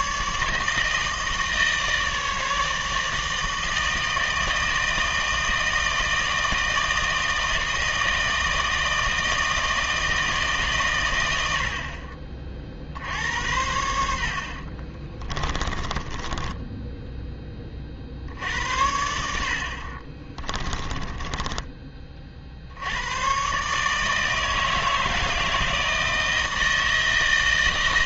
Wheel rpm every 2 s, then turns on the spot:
150, 150, 160, 160, 160, 130, 50, 40, 10, 70, 20, 60, 160, 160.
14-18 20-22